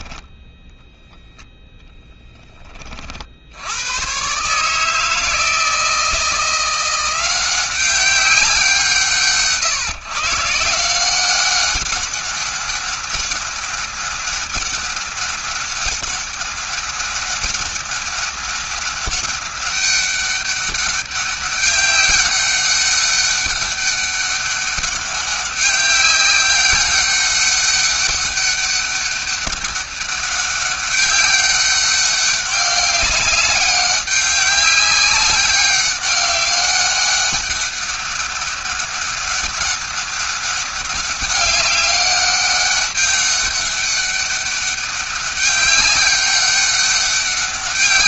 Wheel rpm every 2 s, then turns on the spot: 0, 30, 150, 170, 180, 170, 200, 200, 200, 200, 200, 200, 200, 200, 200, 200, 200, 200, 190, 200, 200, 200, 200, 200.
none